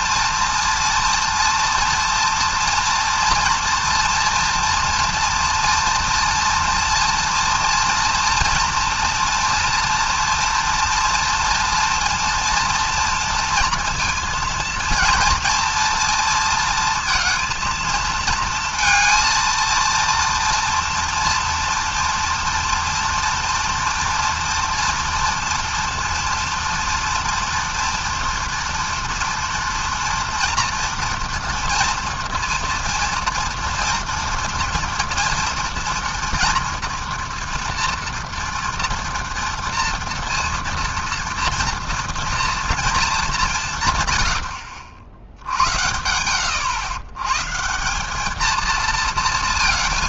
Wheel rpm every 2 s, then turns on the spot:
230, 230, 240, 230, 240, 230, 230, 230, 230, 230, 230, 230, 230, 230, 230, 240, 230, 230, 230, 230, 230, 230, 70, 90, 220.
44-46